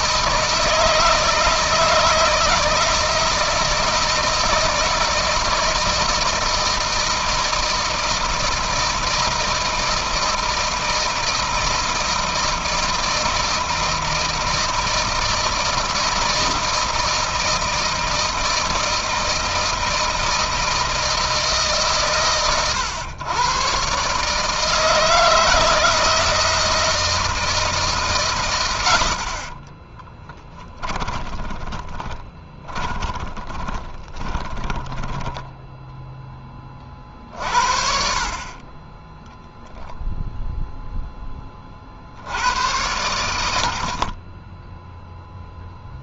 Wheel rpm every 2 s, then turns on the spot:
160, 160, 160, 160, 160, 160, 160, 160, 160, 160, 160, 120, 160, 160, 70, 20, 20, 10, 40, 20, 10, 100, 0.
28-36